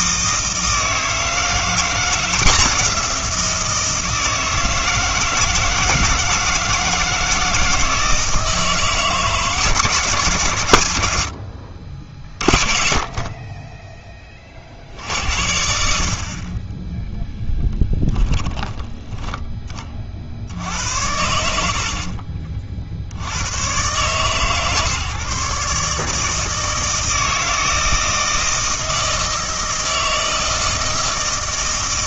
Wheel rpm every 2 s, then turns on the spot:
160, 180, 160, 160, 160, 110, 30, 70, 20, 20, 70, 50, 150, 160, 160, 160.
18-20